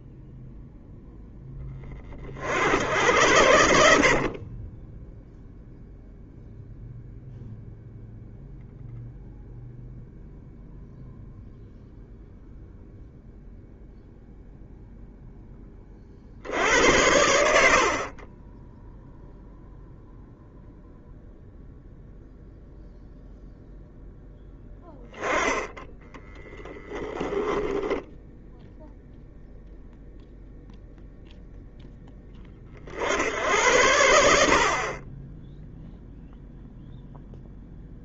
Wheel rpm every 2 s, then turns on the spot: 0, 80, 10, 0, 0, 0, 0, 0, 80, 0, 0, 0, 10, 10, 0, 0, 50, 40, 0.
4-6 26-28